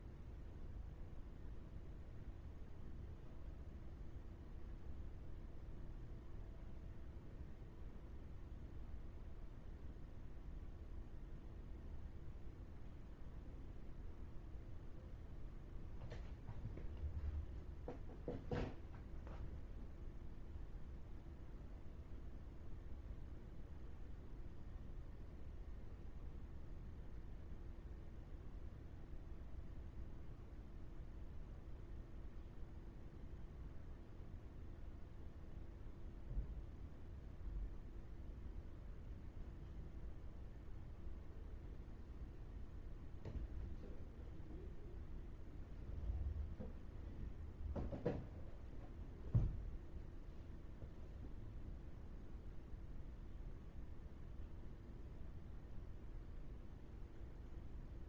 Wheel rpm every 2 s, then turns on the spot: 0, 0, 0, 0, 0, 0, 0, 0, 0, 0, 0, 0, 0, 0, 0, 0, 0, 0, 0, 0, 0, 0, 0, 0, 0, 0, 0, 0, 0.
none